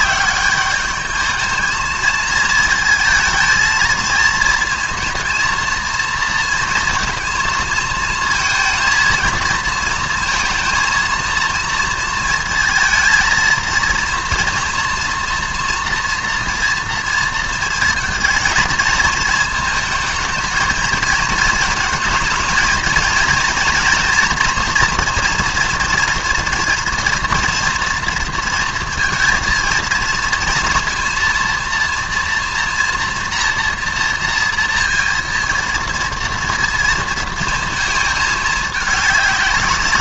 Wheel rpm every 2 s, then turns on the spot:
200, 230, 230, 230, 230, 230, 230, 240, 240, 220, 220, 220, 230, 230, 230, 230, 230, 230, 230, 210.
none